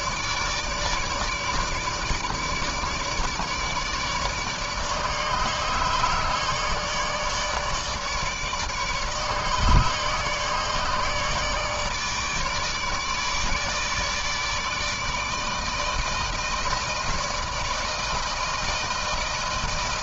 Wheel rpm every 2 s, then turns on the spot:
150, 150, 150, 150, 150, 150, 150, 160, 160, 160.
none